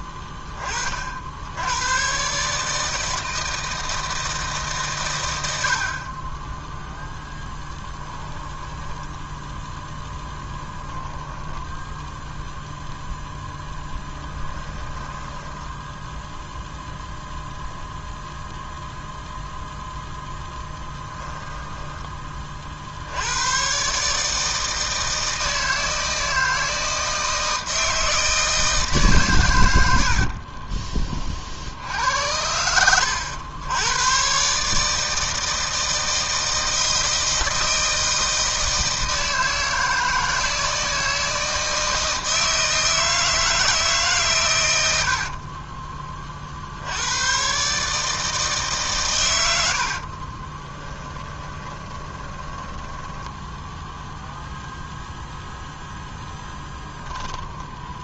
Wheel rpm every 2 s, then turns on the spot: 30, 150, 150, 10, 10, 20, 0, 10, 0, 0, 10, 40, 160, 160, 160, 40, 90, 140, 160, 160, 160, 160, 120, 50, 150, 20, 10, 0, 0.
8-12 14-16 30-34 50-54